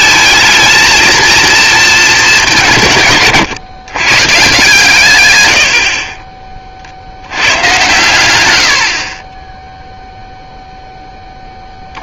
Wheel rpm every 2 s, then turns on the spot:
220, 150, 130, 70, 50, 40.
none